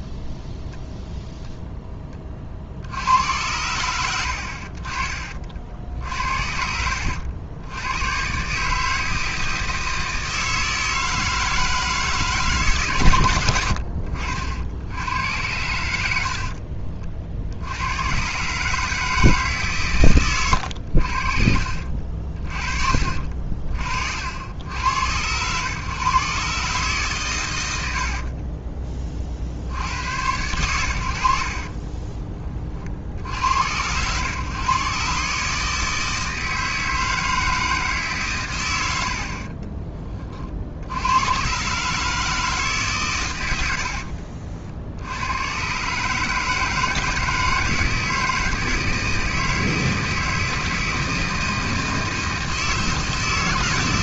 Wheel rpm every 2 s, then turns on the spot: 0, 50, 60, 70, 140, 160, 150, 70, 50, 150, 90, 50, 80, 140, 20, 90, 30, 130, 160, 100, 60, 150, 70, 160, 160, 160, 160.
16-18 20-22